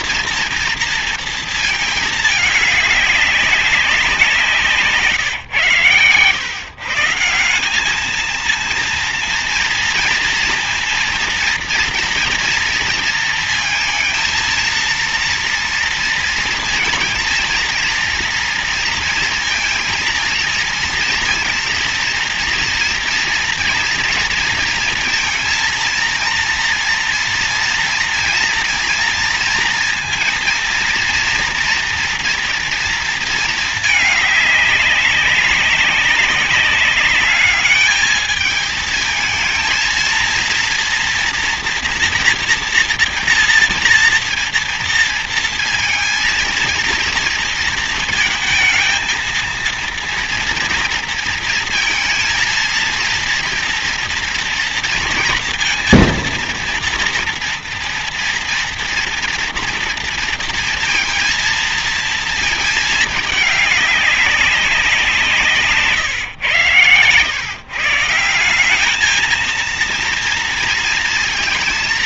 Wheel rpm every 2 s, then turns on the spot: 230, 210, 160, 130, 220, 230, 230, 230, 230, 230, 230, 230, 230, 230, 230, 230, 230, 210, 200, 220, 230, 230, 230, 230, 220, 230, 230, 230, 230, 240, 230, 230, 200, 120, 180, 230.
none